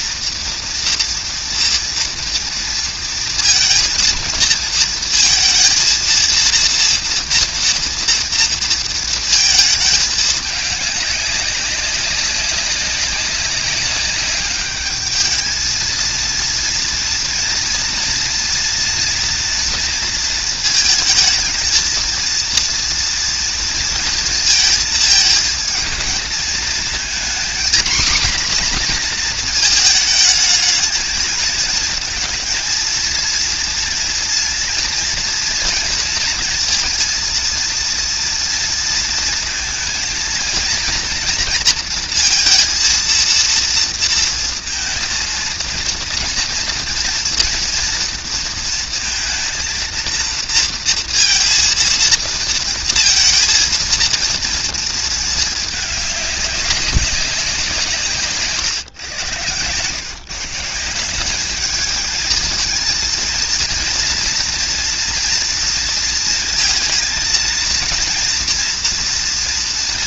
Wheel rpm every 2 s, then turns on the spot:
230, 230, 230, 230, 230, 200, 190, 210, 230, 230, 220, 230, 220, 230, 240, 220, 230, 230, 230, 230, 230, 230, 230, 230, 230, 230, 230, 230, 200, 140, 170, 220, 240, 230, 230.
none